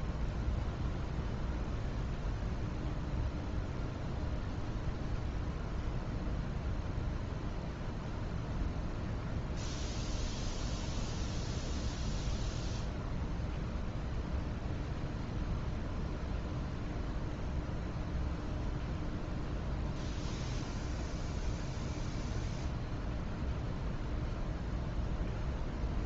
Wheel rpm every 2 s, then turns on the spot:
0, 0, 0, 0, 0, 0, 0, 0, 0, 0, 0, 0, 0.
none